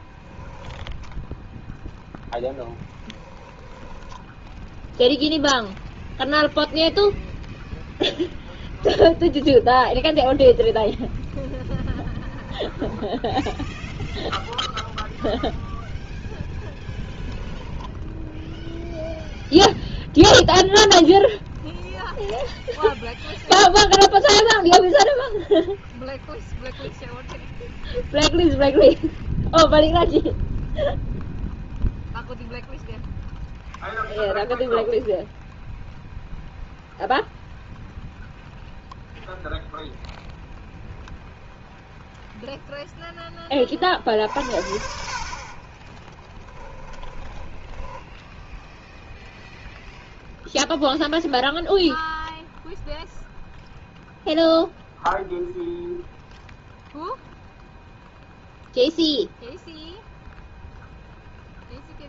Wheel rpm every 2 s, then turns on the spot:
30, 10, 0, 0, 0, 0, 10, 0, 10, 0, 10, 10, 0, 0, 0, 0, 0, 0, 0, 0, 0, 0, 60, 10, 0, 0, 0, 0, 0, 0, 0.
0-4 12-14 16-18 46-48